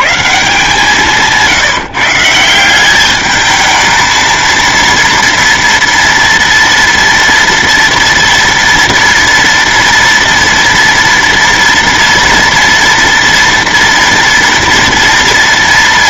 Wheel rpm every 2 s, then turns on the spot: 170, 190, 230, 230, 230, 230, 230, 230.
none